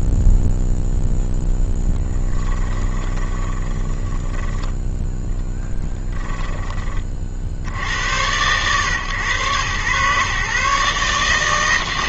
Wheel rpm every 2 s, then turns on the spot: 0, 20, 10, 20, 110, 130.
2-6